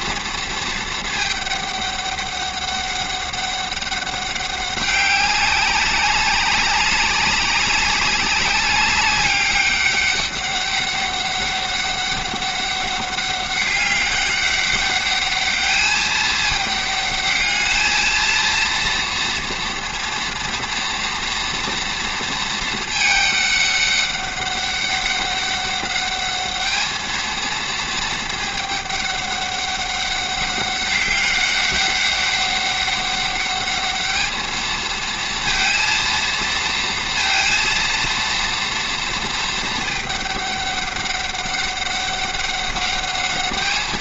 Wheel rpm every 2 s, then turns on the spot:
230, 200, 200, 200, 200, 200, 200, 200, 210, 230, 230, 230, 200, 210, 210, 200, 200, 220, 230, 230, 200, 200.
none